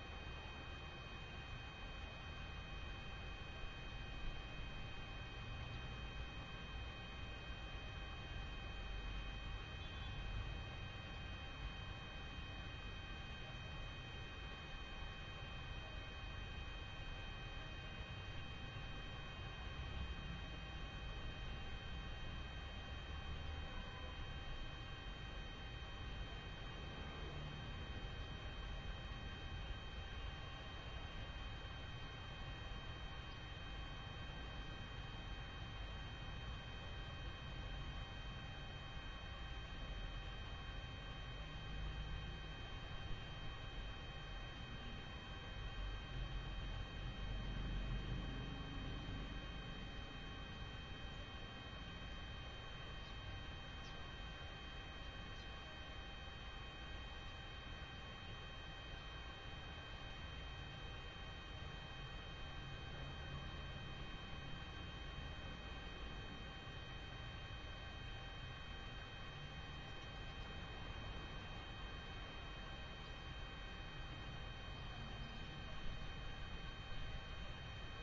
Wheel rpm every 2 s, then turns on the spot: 0, 0, 0, 0, 0, 0, 0, 0, 0, 0, 0, 0, 0, 0, 0, 0, 0, 0, 0, 0, 0, 0, 0, 0, 0, 0, 0, 0, 0, 0, 0, 0, 0, 0, 0, 0, 0, 0, 0.
none